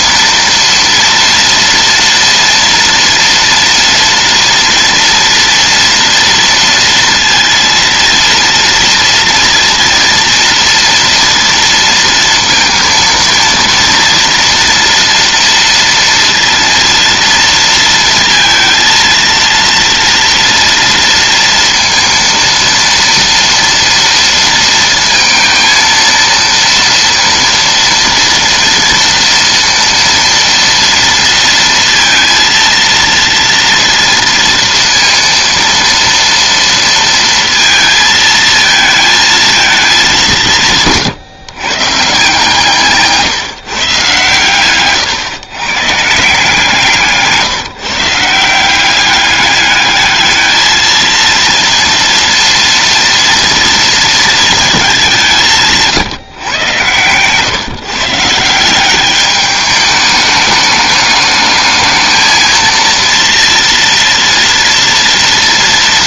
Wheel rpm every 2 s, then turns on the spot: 230, 230, 230, 230, 230, 230, 230, 230, 230, 230, 230, 230, 230, 230, 230, 230, 230, 230, 230, 220, 160, 160, 130, 170, 180, 220, 230, 210, 120, 180, 210, 230, 230.
none